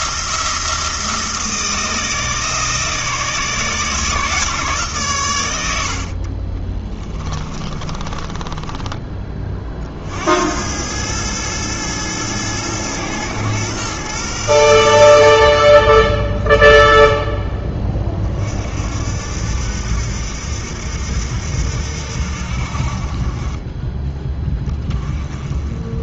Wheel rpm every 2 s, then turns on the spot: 160, 160, 140, 20, 20, 100, 110, 90, 30, 50, 80, 50, 20.
6-10 16-18